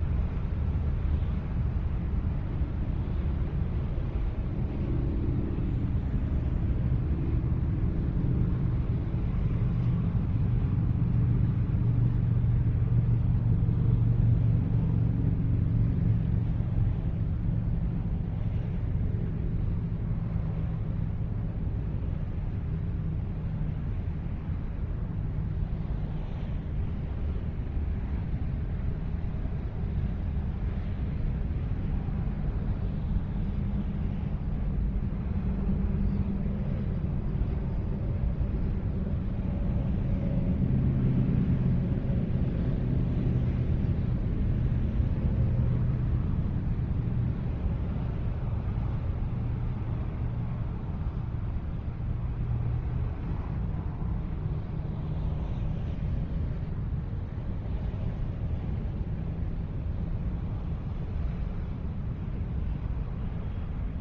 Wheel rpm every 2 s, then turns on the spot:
0, 0, 0, 0, 0, 0, 0, 0, 0, 0, 0, 0, 0, 0, 0, 0, 0, 0, 0, 0, 0, 0, 0, 0, 0, 0, 0, 0, 0, 0, 0, 0.
none